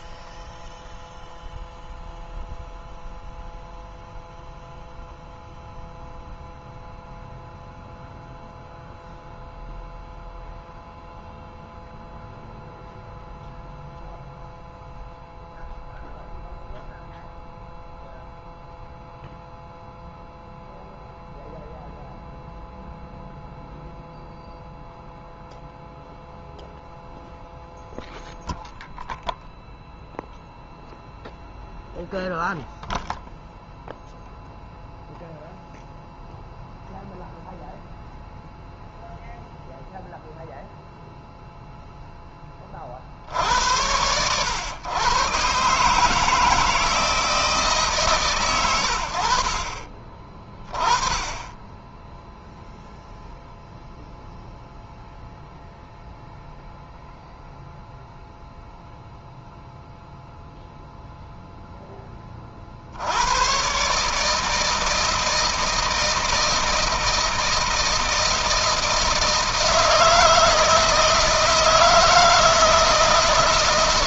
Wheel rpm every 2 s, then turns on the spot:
0, 0, 0, 0, 0, 0, 0, 0, 0, 0, 0, 0, 0, 0, 0, 0, 0, 0, 0, 0, 0, 20, 110, 160, 130, 30, 0, 0, 0, 0, 0, 20, 150, 160, 160, 160, 160.
none